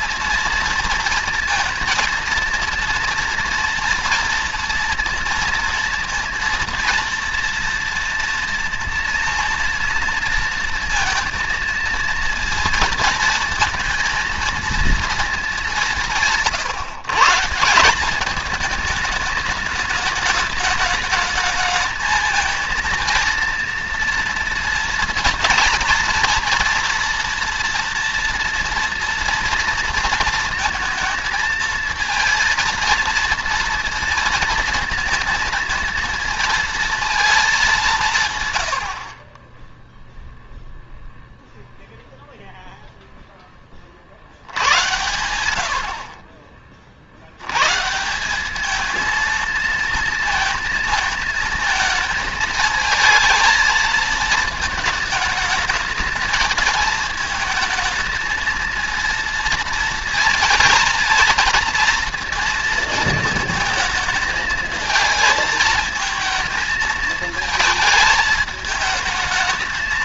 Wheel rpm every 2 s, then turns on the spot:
230, 230, 230, 230, 230, 230, 230, 230, 150, 210, 210, 230, 230, 230, 230, 230, 230, 230, 230, 130, 0, 0, 80, 40, 190, 220, 220, 210, 220, 220, 230, 230, 220, 220, 220.
none